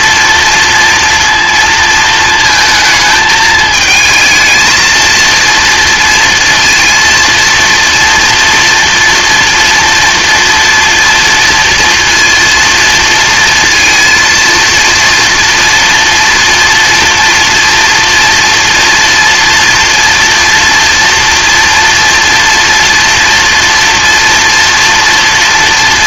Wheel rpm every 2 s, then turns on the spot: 230, 220, 220, 230, 230, 230, 230, 230, 230, 230, 230, 230, 240.
none